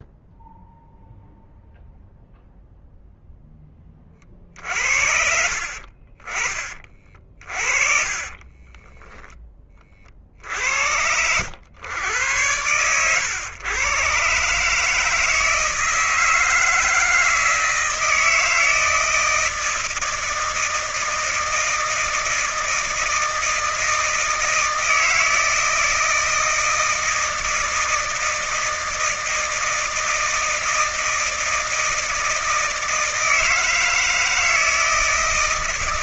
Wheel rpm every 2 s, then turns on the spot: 0, 0, 40, 40, 30, 50, 100, 130, 160, 160, 160, 160, 160, 160, 160, 160, 160, 160.
8-10 12-14